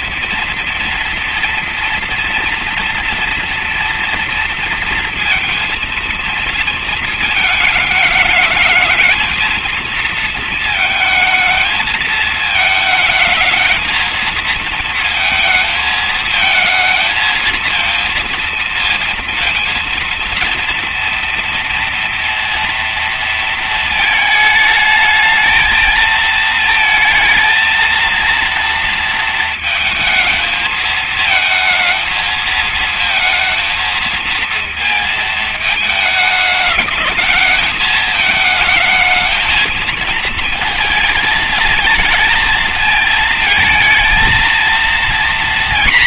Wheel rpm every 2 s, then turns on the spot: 230, 230, 230, 230, 220, 220, 220, 230, 220, 230, 230, 230, 220, 230, 230, 220, 220, 220, 210, 220, 220, 230, 230.
none